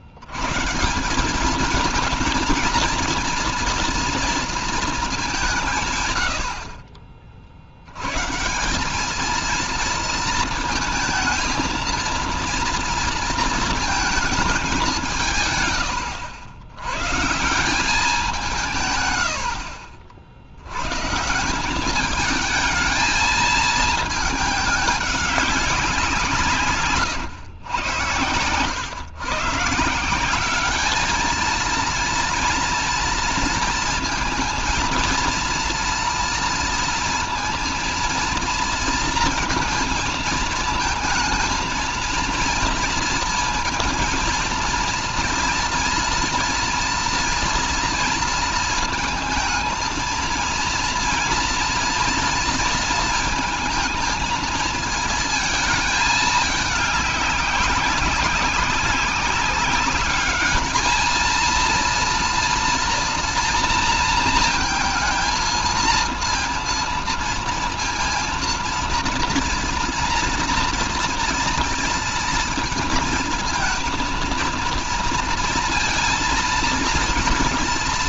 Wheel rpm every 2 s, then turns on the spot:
140, 230, 230, 50, 180, 220, 230, 200, 100, 150, 100, 210, 210, 140, 110, 200, 230, 230, 230, 230, 220, 230, 230, 230, 220, 230, 230, 220, 210, 190, 220, 240, 230, 230, 230, 230, 230, 230, 230.
none